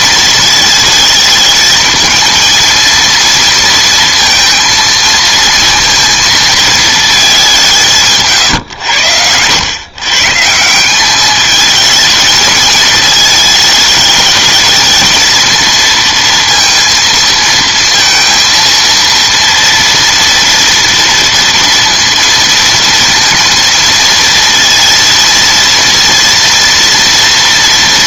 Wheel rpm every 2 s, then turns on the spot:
220, 230, 230, 230, 140, 150, 220, 220, 230, 230, 240, 230, 230, 230.
none